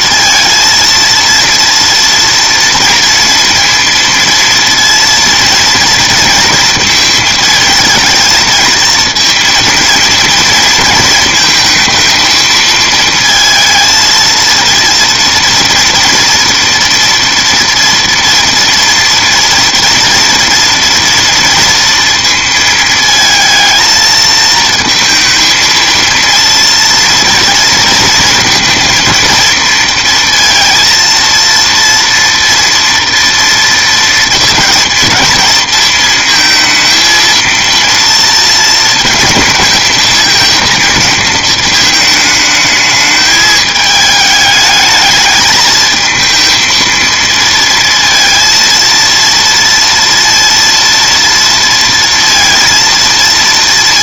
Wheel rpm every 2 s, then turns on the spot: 230, 230, 230, 230, 230, 230, 220, 230, 230, 230, 240, 230, 230, 230, 220, 230, 230, 230, 220, 220, 220, 220, 210, 230, 230, 230, 230.
none